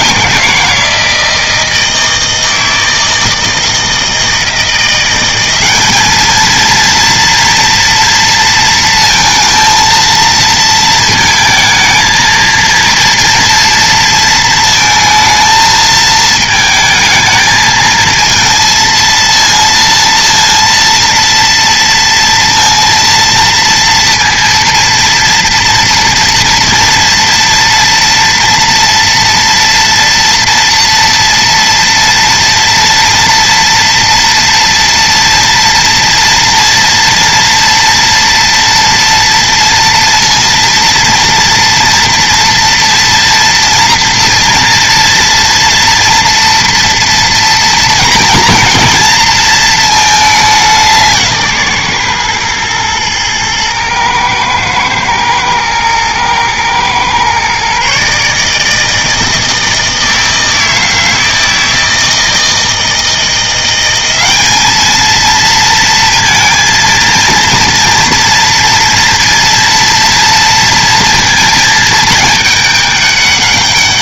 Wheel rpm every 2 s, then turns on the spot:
170, 160, 180, 230, 230, 230, 230, 220, 220, 220, 230, 230, 230, 230, 230, 230, 230, 230, 230, 230, 230, 230, 230, 230, 230, 180, 110, 110, 120, 160, 160, 160, 210, 230, 230, 230, 210.
none